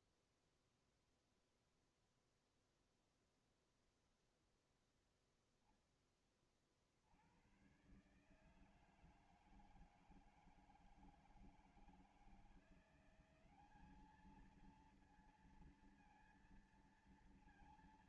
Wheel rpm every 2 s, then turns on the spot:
0, 0, 0, 30, 150, 160, 170, 220, 230.
none